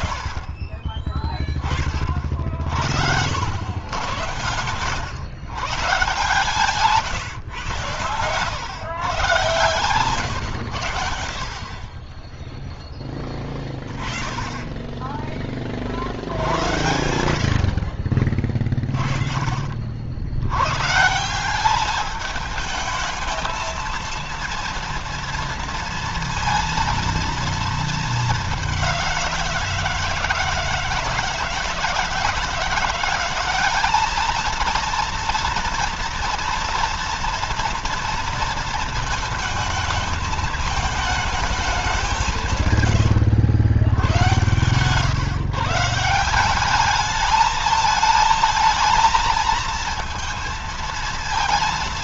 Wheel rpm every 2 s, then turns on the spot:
20, 40, 110, 150, 120, 110, 10, 20, 90, 40, 100, 210, 230, 230, 200, 160, 160, 220, 230, 230, 220, 180, 120, 190, 220, 230.
none